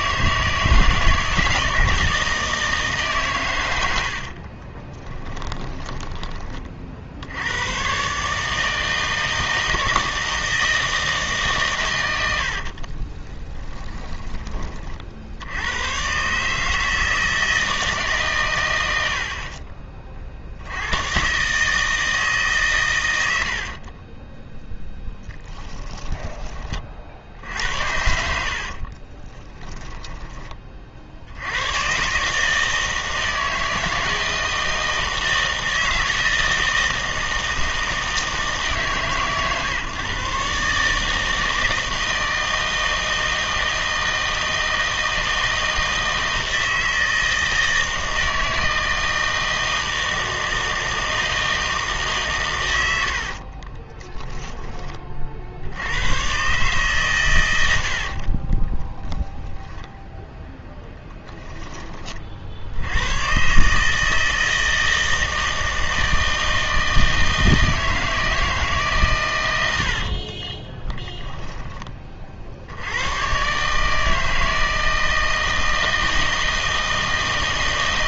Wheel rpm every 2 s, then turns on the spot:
160, 160, 30, 40, 160, 160, 50, 30, 150, 100, 80, 130, 0, 30, 60, 40, 160, 160, 160, 150, 140, 160, 160, 160, 160, 160, 110, 10, 130, 30, 10, 80, 160, 160, 150, 20, 80, 160, 160.
4-6 12-14 28-30 58-60 70-72